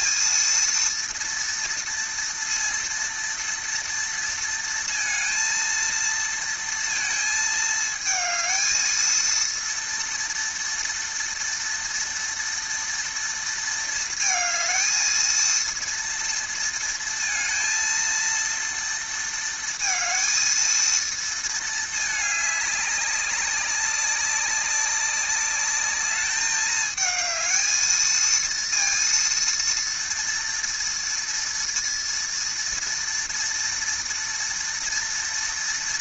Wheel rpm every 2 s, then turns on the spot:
230, 230, 230, 230, 220, 230, 230, 220, 230, 230, 230, 210, 190, 210, 230, 230, 230, 230.
none